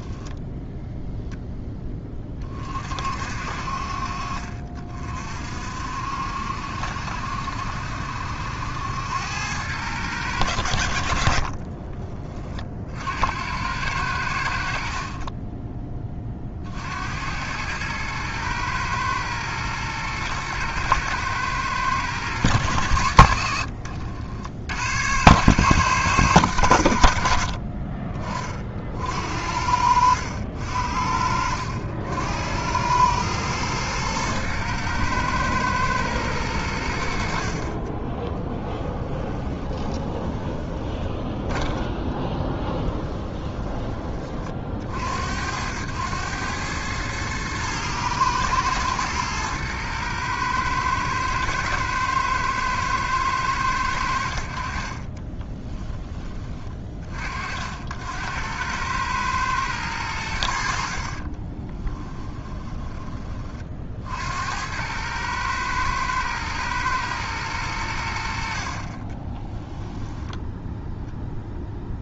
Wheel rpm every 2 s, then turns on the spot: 0, 50, 50, 70, 90, 60, 60, 50, 70, 110, 120, 90, 100, 90, 50, 60, 100, 110, 100, 20, 20, 20, 50, 100, 110, 110, 110, 60, 20, 90, 70, 20, 90, 110, 50, 0.
38-44 62-64